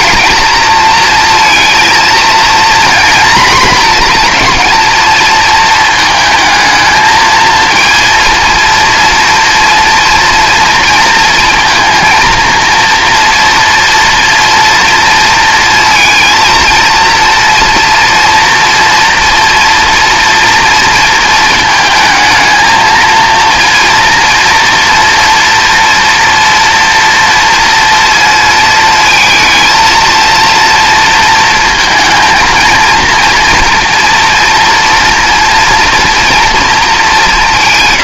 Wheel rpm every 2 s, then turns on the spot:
230, 230, 230, 220, 230, 230, 230, 230, 230, 230, 230, 220, 230, 230, 220, 230, 230, 230, 230.
none